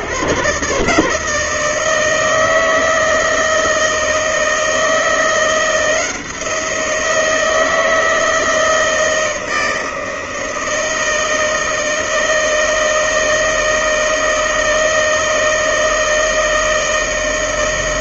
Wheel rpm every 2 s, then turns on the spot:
140, 160, 170, 170, 160, 160, 160, 160, 160.
none